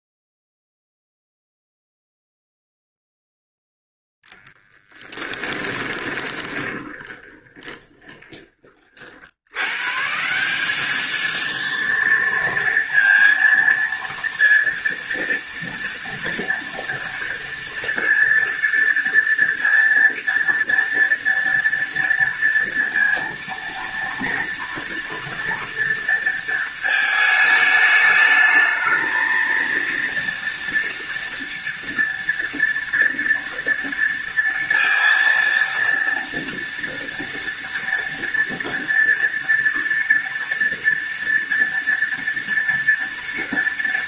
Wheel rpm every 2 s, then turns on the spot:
0, 0, 10, 20, 20, 170, 230, 230, 230, 230, 230, 230, 230, 230, 210, 230, 230, 230, 230, 230, 230, 230.
6-8